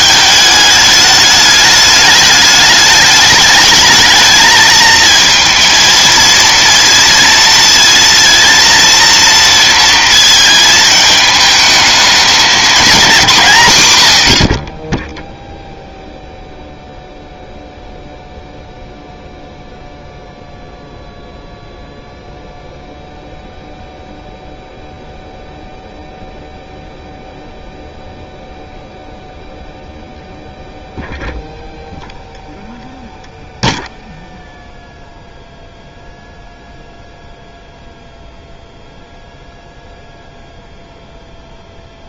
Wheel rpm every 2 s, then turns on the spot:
210, 210, 220, 230, 230, 220, 220, 60, 0, 0, 0, 0, 0, 0, 0, 0, 0, 0, 0, 0, 0.
none